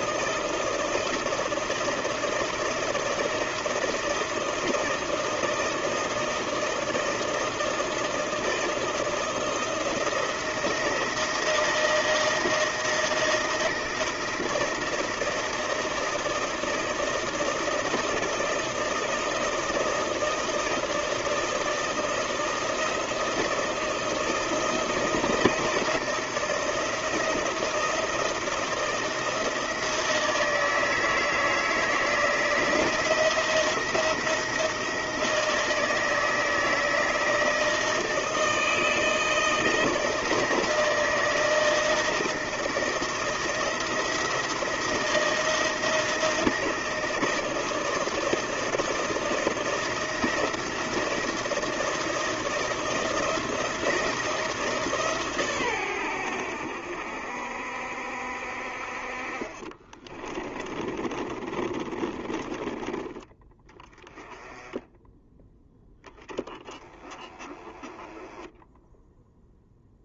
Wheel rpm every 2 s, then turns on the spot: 160, 160, 160, 160, 160, 160, 160, 160, 160, 160, 160, 160, 160, 160, 160, 160, 170, 160, 160, 160, 160, 160, 170, 160, 160, 170, 160, 150, 70, 40, 30, 20, 10, 10, 0.
60-62